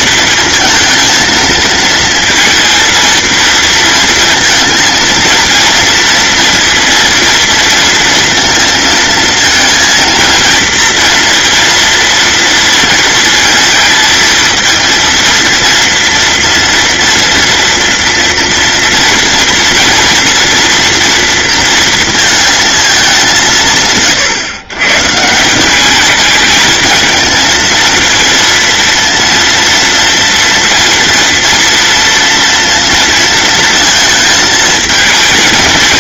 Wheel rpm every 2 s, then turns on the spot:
230, 230, 230, 230, 230, 230, 230, 230, 230, 230, 230, 220, 130, 220, 230, 230, 230, 220.
none